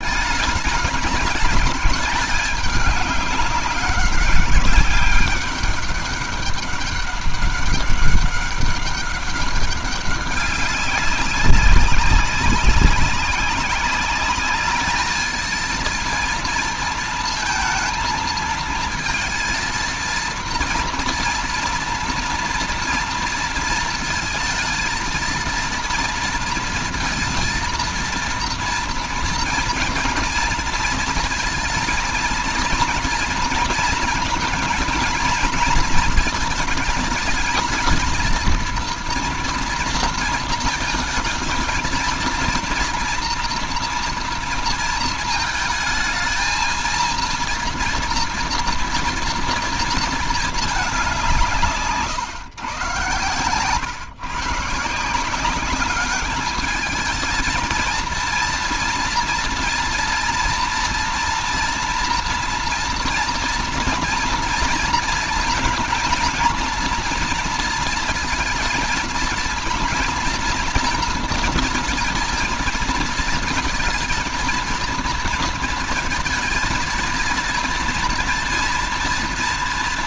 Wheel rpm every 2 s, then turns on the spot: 210, 210, 190, 200, 200, 200, 200, 210, 230, 230, 230, 230, 230, 230, 230, 230, 230, 220, 210, 230, 220, 230, 230, 230, 240, 200, 120, 160, 220, 230, 240, 230, 230, 230, 230, 230, 230, 230, 230, 240.
none